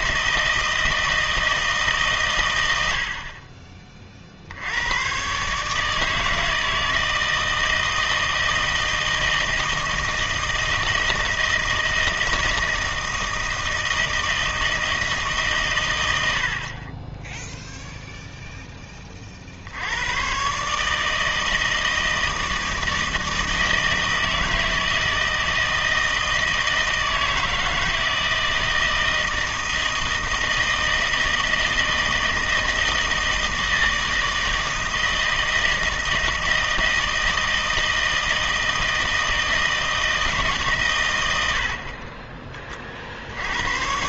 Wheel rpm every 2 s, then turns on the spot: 160, 100, 80, 160, 160, 160, 160, 160, 50, 10, 150, 160, 160, 160, 160, 160, 160, 160, 160, 160, 130, 30.
none